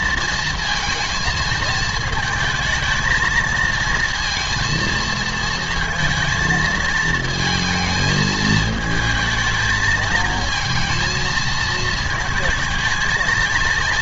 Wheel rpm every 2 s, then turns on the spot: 230, 220, 230, 230, 220, 220, 230.
none